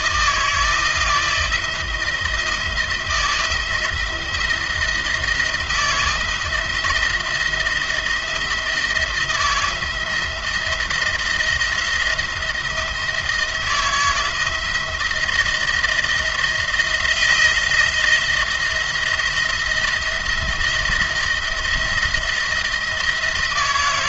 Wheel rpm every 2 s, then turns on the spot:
160, 160, 170, 160, 160, 170, 170, 170, 170, 170, 170, 160.
none